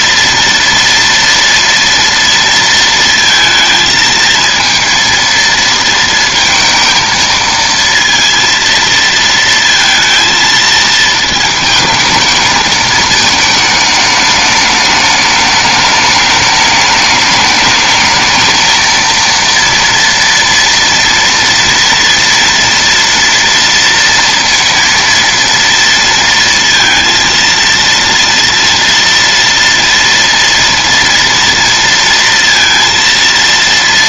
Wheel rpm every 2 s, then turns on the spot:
230, 230, 230, 230, 230, 220, 220, 210, 210, 220, 240, 230, 230, 230, 230, 230, 230.
none